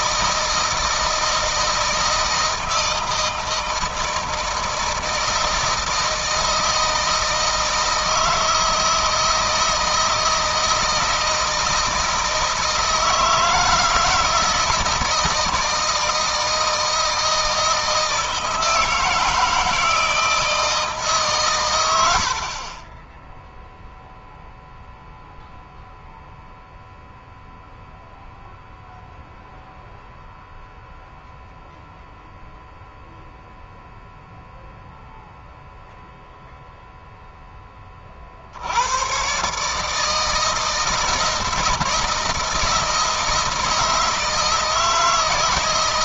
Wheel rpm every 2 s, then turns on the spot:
160, 160, 160, 160, 160, 160, 160, 160, 160, 160, 150, 20, 0, 0, 0, 0, 0, 0, 0, 90, 160, 160, 160.
none